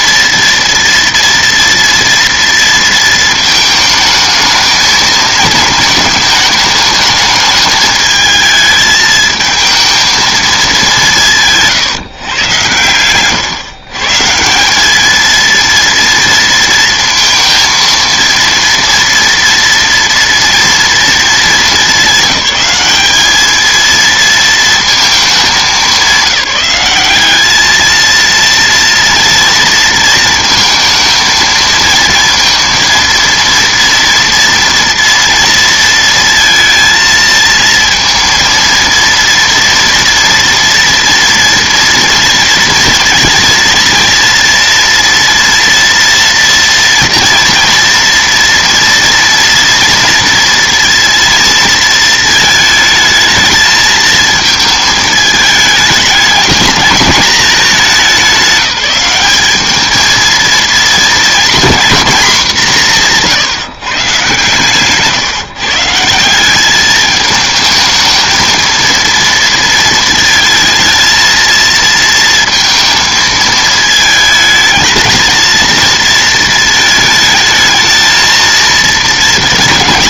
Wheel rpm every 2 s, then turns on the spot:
230, 230, 220, 210, 220, 200, 120, 190, 230, 230, 230, 190, 220, 200, 230, 220, 230, 230, 230, 230, 230, 230, 230, 230, 230, 230, 220, 220, 210, 200, 230, 210, 130, 200, 230, 230, 230, 220, 220, 230.
none